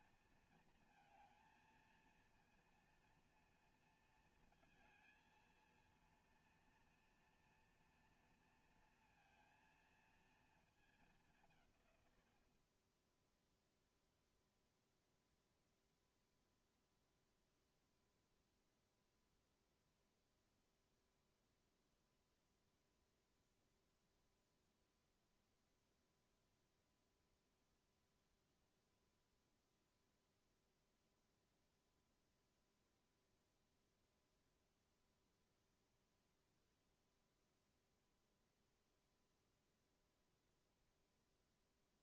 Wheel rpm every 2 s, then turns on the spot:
220, 230, 230, 230, 230, 220, 70, 0, 0, 0, 0, 0, 0, 0, 0, 0, 0, 0, 0, 0, 0.
none